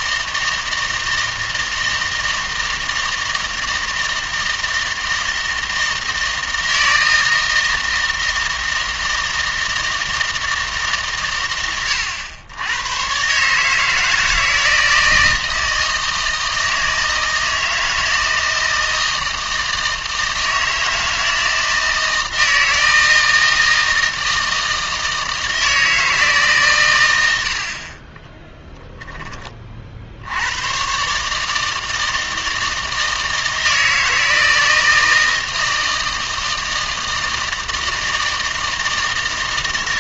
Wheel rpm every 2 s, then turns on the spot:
160, 160, 160, 160, 160, 140, 100, 160, 160, 160, 160, 160, 160, 120, 10, 120, 160, 160, 160, 160.
none